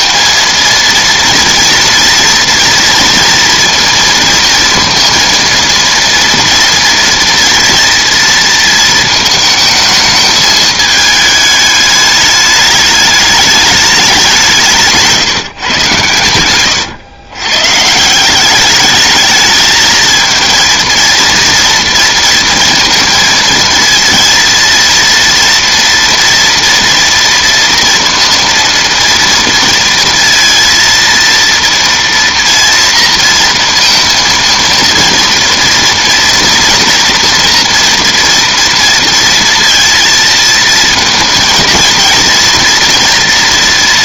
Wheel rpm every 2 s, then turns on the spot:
230, 230, 230, 230, 230, 210, 210, 170, 110, 200, 230, 230, 230, 230, 230, 230, 230, 230, 230, 230, 230, 240.
16-18